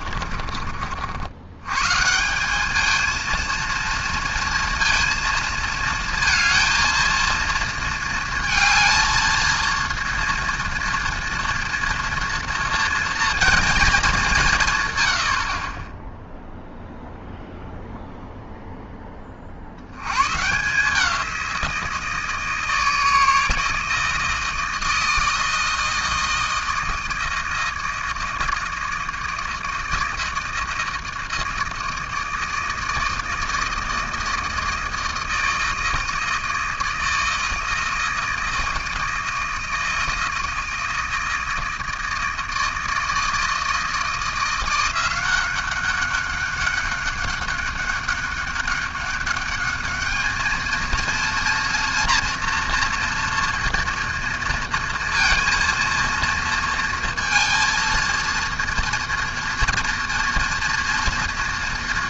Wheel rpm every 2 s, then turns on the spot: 50, 210, 230, 230, 230, 230, 230, 140, 0, 0, 160, 160, 160, 160, 160, 160, 160, 160, 160, 160, 160, 160, 170, 200, 200, 220, 240, 230, 230, 230, 240.
none